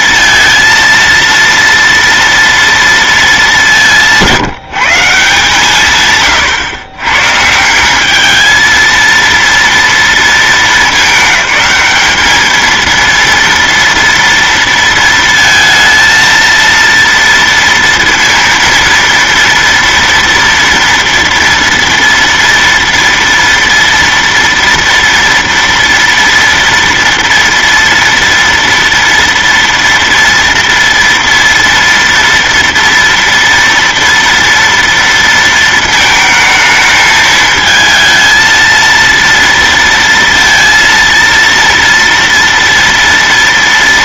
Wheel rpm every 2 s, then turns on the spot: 230, 230, 160, 120, 230, 210, 230, 230, 230, 230, 230, 230, 230, 240, 230, 230, 230, 230, 220, 230, 230, 230.
none